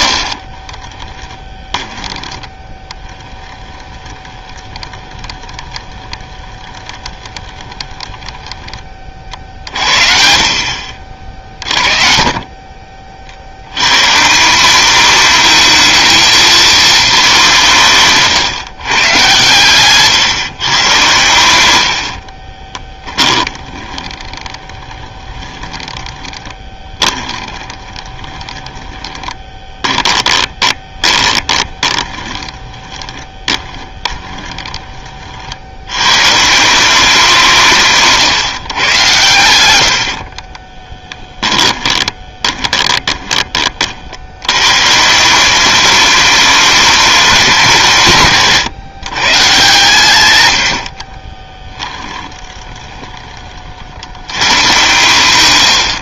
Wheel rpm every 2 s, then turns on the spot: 30, 10, 20, 20, 30, 60, 30, 200, 220, 130, 120, 20, 20, 20, 20, 20, 20, 30, 180, 120, 20, 20, 130, 210, 150, 80, 20, 120.
0-8 22-34 40-44 52-54